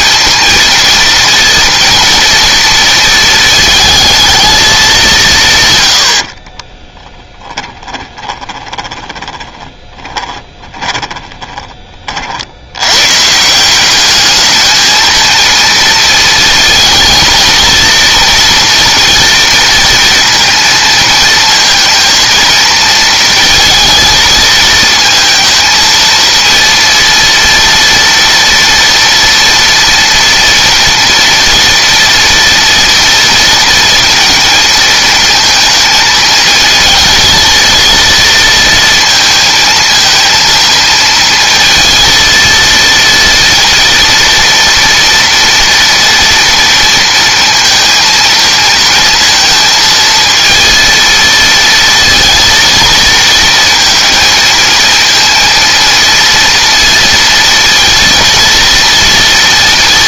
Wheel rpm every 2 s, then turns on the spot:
230, 230, 190, 10, 20, 20, 110, 220, 230, 230, 230, 230, 220, 230, 230, 230, 230, 230, 220, 230, 230, 230, 230, 230, 230, 230, 230, 230, 230, 230.
6-12